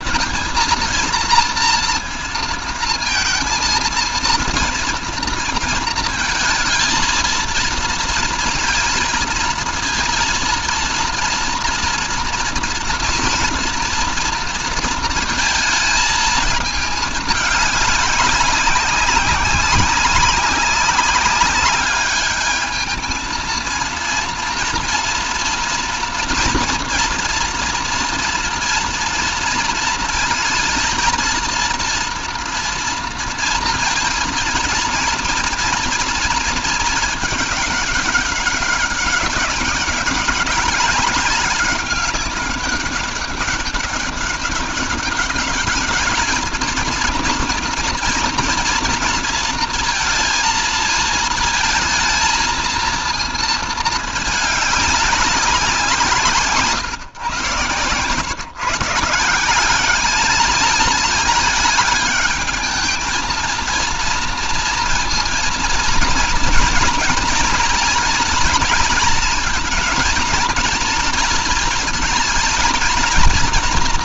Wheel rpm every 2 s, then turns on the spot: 230, 230, 230, 220, 230, 230, 230, 230, 220, 200, 190, 220, 230, 240, 230, 230, 230, 230, 220, 200, 190, 200, 200, 230, 230, 230, 230, 210, 140, 140, 210, 210, 230, 230, 230, 230, 230.
none